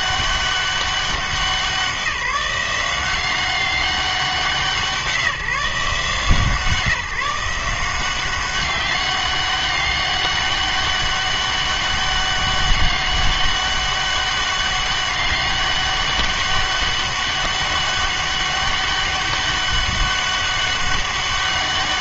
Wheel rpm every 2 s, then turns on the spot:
200, 180, 180, 160, 190, 200, 200, 200, 200, 200, 200.
none